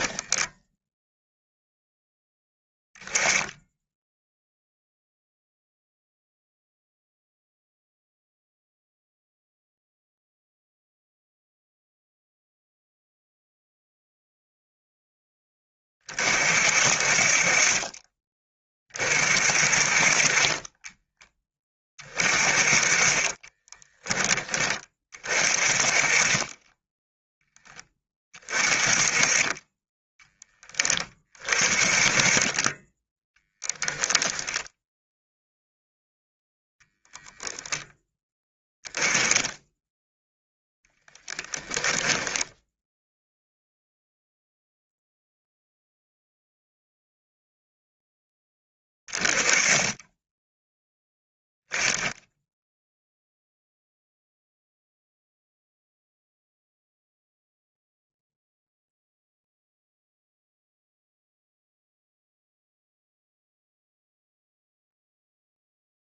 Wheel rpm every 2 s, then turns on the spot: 0, 0, 0, 0, 0, 0, 0, 0, 50, 30, 20, 30, 30, 10, 30, 30, 20, 0, 0, 10, 0, 0, 0, 0, 20, 10, 0, 0, 0, 0, 0, 0, 0.
none